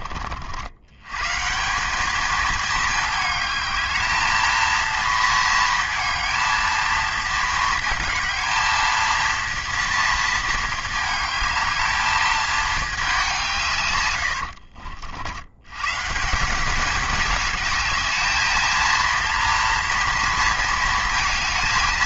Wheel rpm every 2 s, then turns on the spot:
210, 220, 220, 220, 230, 220, 120, 150, 210, 230, 230.
none